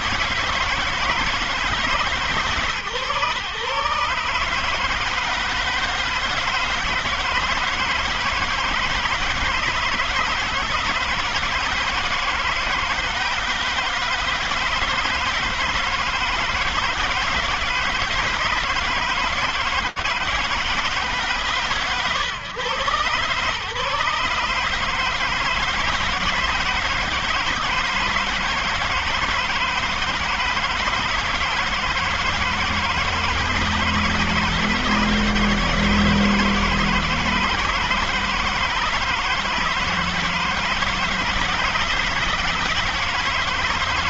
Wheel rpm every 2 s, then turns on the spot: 170, 130, 160, 170, 160, 160, 160, 160, 160, 160, 130, 140, 160, 160, 160, 160, 160, 160, 160, 160, 160, 160.
none